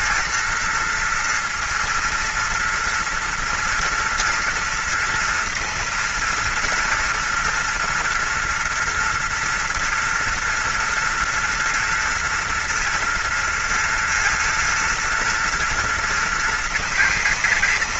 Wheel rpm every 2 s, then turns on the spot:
240, 230, 230, 230, 240, 230, 230, 230, 230.
none